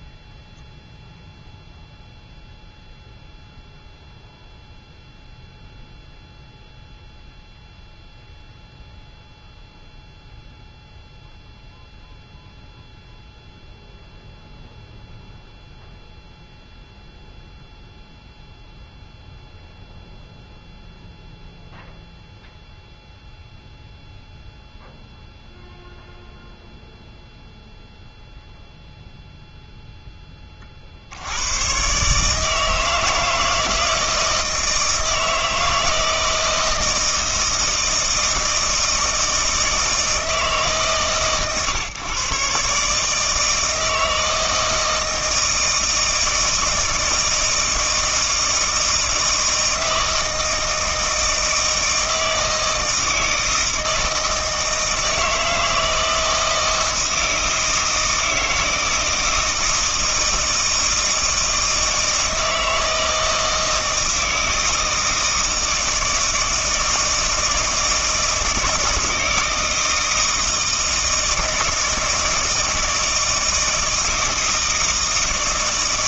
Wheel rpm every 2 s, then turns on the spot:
0, 0, 0, 0, 0, 0, 0, 0, 0, 0, 0, 0, 0, 0, 0, 40, 160, 160, 160, 160, 150, 140, 160, 160, 160, 160, 160, 160, 160, 160, 160, 160, 160, 160, 160, 160, 160, 160.
none